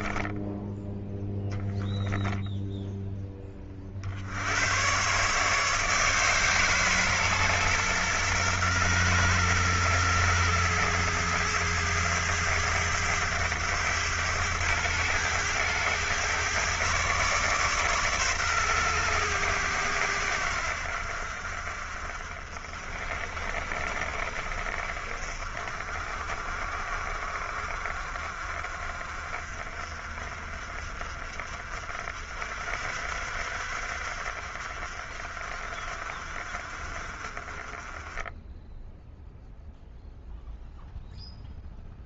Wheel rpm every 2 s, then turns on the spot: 10, 0, 100, 140, 120, 110, 100, 100, 130, 120, 70, 50, 50, 40, 40, 40, 60, 50, 40, 0, 0.
none